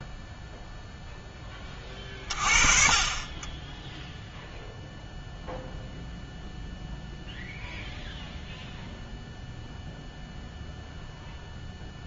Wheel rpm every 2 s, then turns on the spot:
0, 30, 0, 0, 0, 0.
none